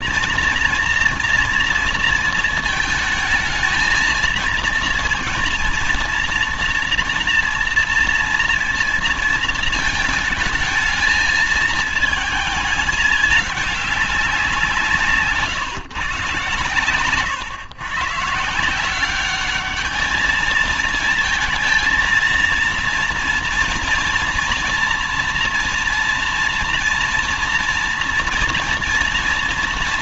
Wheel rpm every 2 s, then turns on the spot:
230, 220, 230, 230, 230, 220, 210, 160, 130, 190, 220, 230, 230, 240, 230.
none